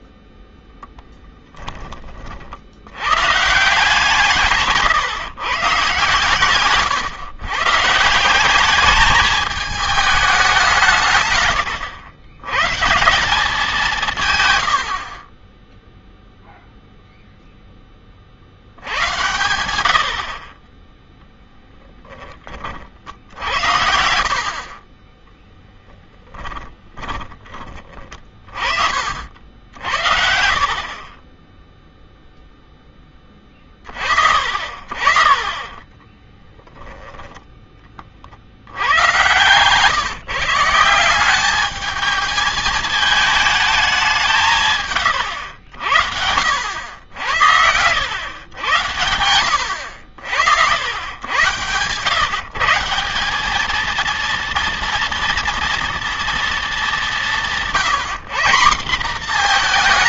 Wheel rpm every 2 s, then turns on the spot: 0, 80, 150, 140, 200, 170, 160, 80, 0, 70, 20, 40, 40, 30, 50, 40, 10, 50, 10, 90, 160, 220, 140, 80, 100, 80, 150, 230, 220, 200.
26-28 46-48